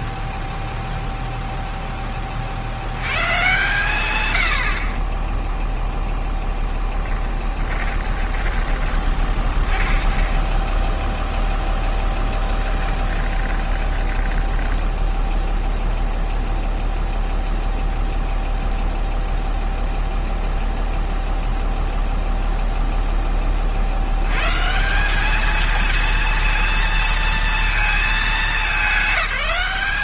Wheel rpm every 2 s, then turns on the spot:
0, 90, 40, 10, 10, 0, 10, 10, 0, 0, 0, 0, 160, 230, 210.
6-8 12-16